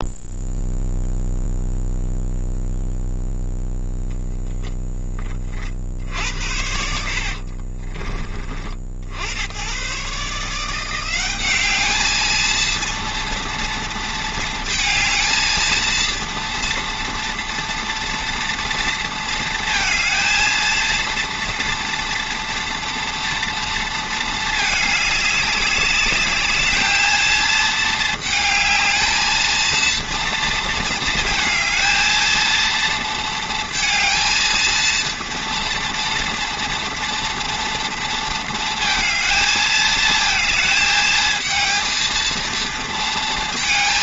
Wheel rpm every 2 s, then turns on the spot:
0, 0, 20, 70, 80, 180, 230, 220, 230, 230, 230, 230, 210, 220, 220, 230, 230, 230, 230, 220, 220, 230.
6-8